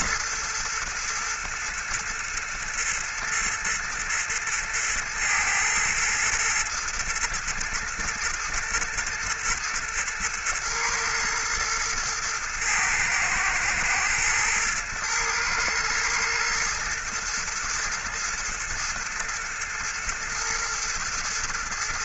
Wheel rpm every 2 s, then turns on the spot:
110, 120, 110, 110, 110, 110, 110, 120, 120, 110, 110.
none